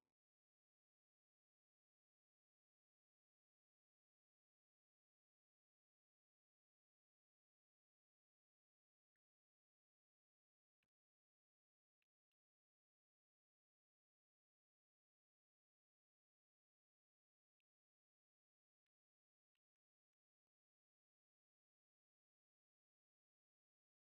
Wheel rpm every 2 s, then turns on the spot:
0, 0, 0, 0, 0, 0, 0, 0, 0, 0, 0, 0.
none